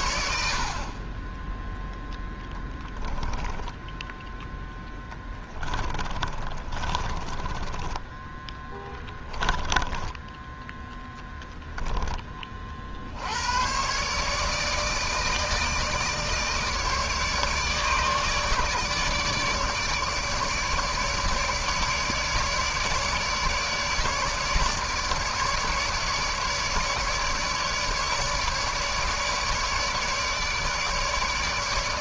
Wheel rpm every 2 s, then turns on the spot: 50, 0, 10, 30, 10, 10, 30, 150, 150, 150, 150, 150, 150, 150, 150, 150.
6-10